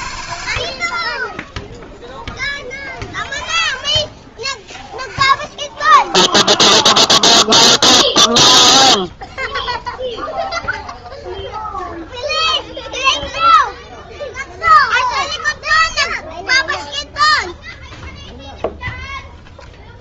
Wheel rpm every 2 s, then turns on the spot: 10, 0, 0, 0, 0, 0, 0, 0, 0, 0.
none